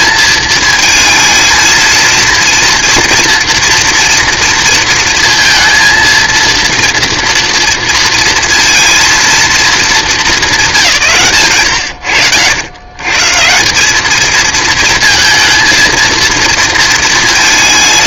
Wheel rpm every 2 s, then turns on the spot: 220, 230, 230, 230, 230, 160, 120, 220, 230.
none